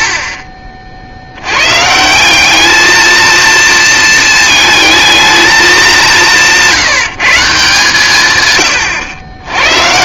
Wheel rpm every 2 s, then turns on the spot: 20, 170, 220, 190, 140.
none